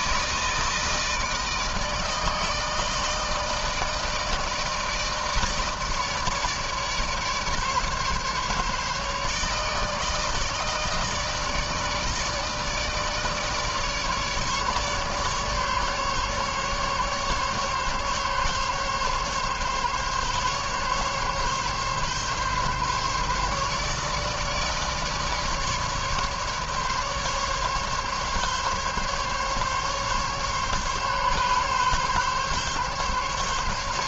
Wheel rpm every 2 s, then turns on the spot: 160, 160, 160, 150, 150, 150, 160, 150, 140, 140, 140, 140, 150, 140, 140, 140, 140.
none